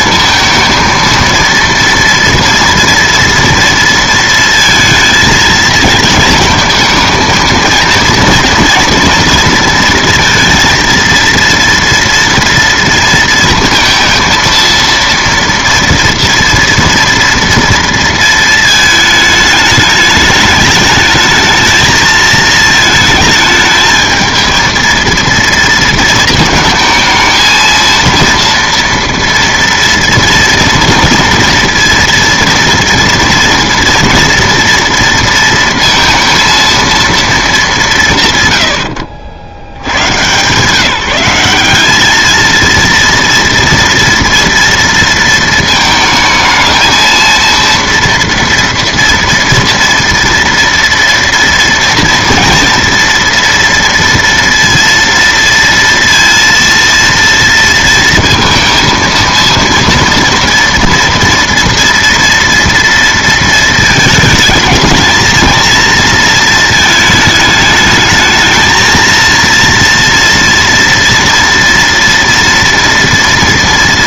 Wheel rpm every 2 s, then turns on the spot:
230, 240, 230, 220, 230, 230, 230, 230, 230, 220, 210, 220, 230, 220, 230, 230, 230, 230, 230, 130, 150, 230, 230, 220, 230, 230, 230, 230, 230, 230, 230, 230, 220, 230, 220, 240, 230.
none